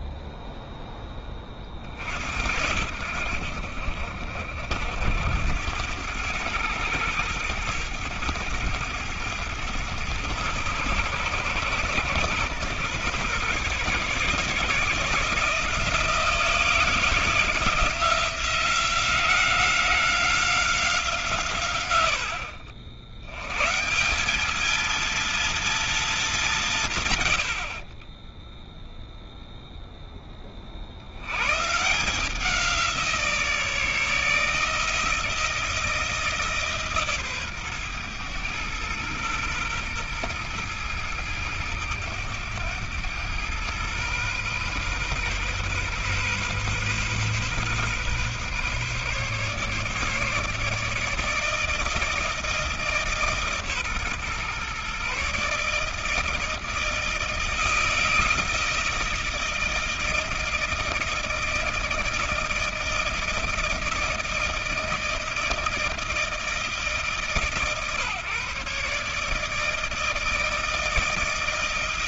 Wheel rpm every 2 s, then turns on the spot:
0, 70, 70, 100, 100, 120, 120, 150, 170, 170, 170, 70, 220, 180, 0, 40, 170, 160, 150, 110, 110, 100, 130, 130, 140, 150, 160, 130, 160, 160, 160, 160, 160, 160, 140, 160.
none